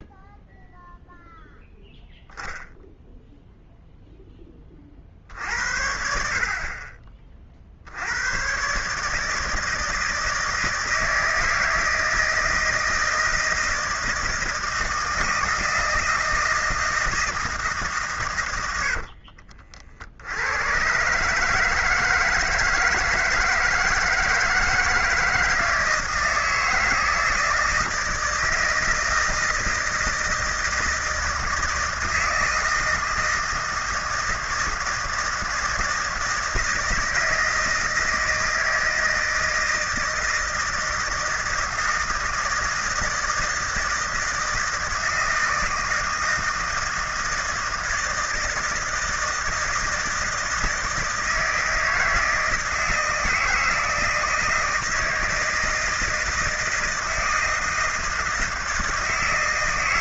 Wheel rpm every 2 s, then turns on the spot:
0, 0, 30, 40, 120, 160, 160, 160, 160, 90, 110, 160, 160, 160, 160, 160, 160, 160, 160, 160, 160, 160, 160, 160, 160, 160, 160, 160, 160, 160.
18-20